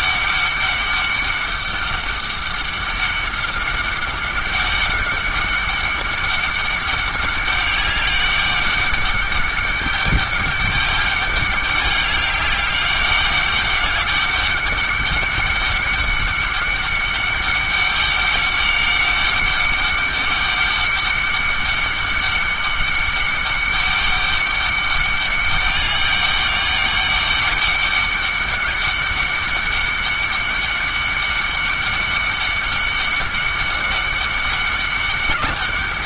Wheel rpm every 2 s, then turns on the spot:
200, 200, 200, 200, 200, 200, 200, 200, 200, 200, 200, 200, 200, 200, 200, 200, 200, 200.
none